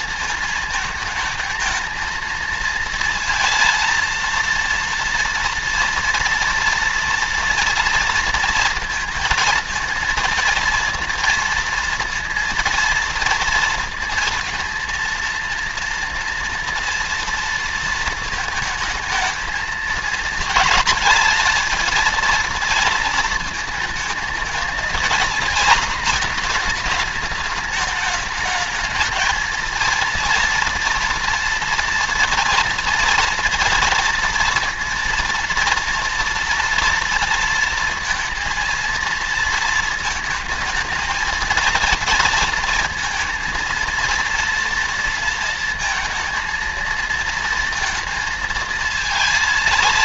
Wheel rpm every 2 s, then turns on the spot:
220, 230, 230, 230, 230, 230, 230, 230, 230, 220, 230, 230, 230, 220, 210, 230, 230, 230, 230, 230, 220, 230, 230, 230, 230.
none